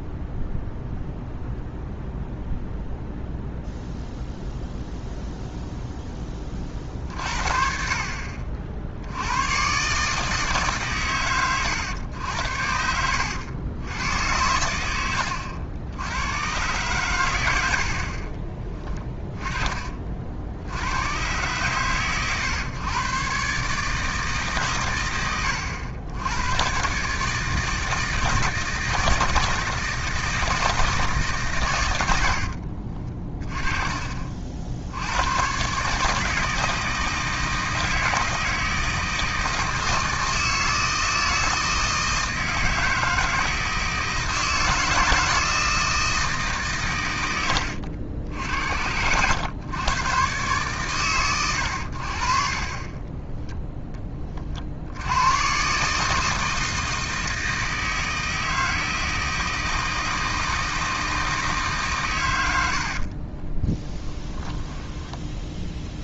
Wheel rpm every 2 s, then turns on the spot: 0, 0, 0, 30, 50, 150, 80, 90, 120, 30, 80, 120, 130, 110, 160, 160, 60, 60, 160, 160, 160, 160, 160, 150, 80, 120, 30, 50, 160, 160, 160, 90, 10.
18-20 32-34 48-50 64-66